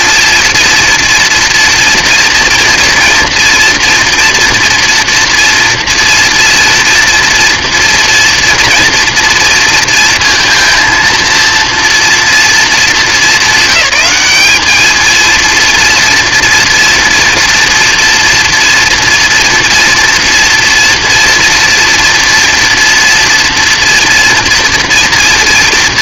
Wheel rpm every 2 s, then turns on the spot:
230, 240, 230, 230, 230, 230, 230, 210, 240, 230, 240, 230, 230.
none